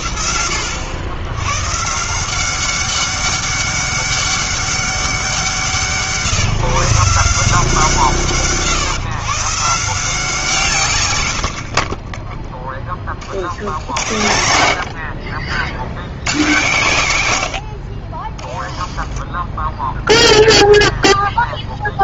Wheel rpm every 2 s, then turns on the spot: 80, 190, 200, 150, 130, 140, 20, 70, 130, 20, 0.
18-20